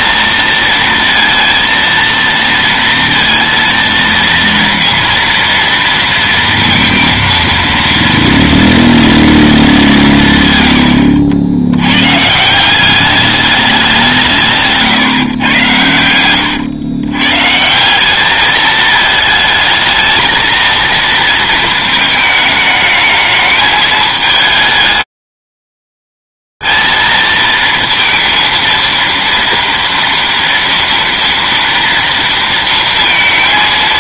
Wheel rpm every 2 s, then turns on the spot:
230, 230, 230, 230, 230, 100, 190, 150, 110, 220, 230, 220, 220, 230, 230, 230, 230.
14-16